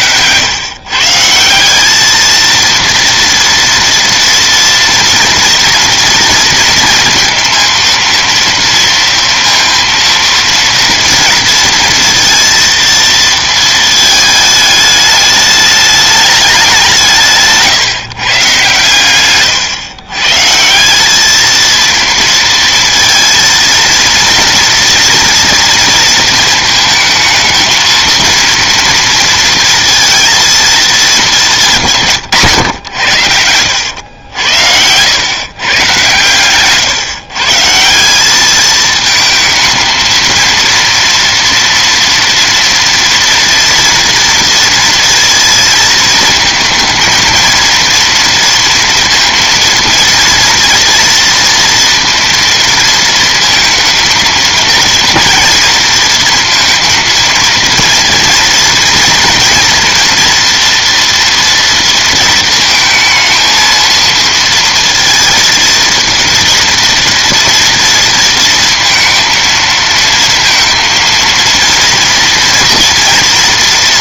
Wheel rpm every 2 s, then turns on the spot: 180, 240, 230, 230, 230, 230, 220, 210, 140, 120, 220, 230, 230, 220, 230, 180, 90, 120, 150, 220, 230, 230, 230, 230, 230, 230, 220, 230, 230, 240, 230, 230, 220, 230, 220, 230, 230.
none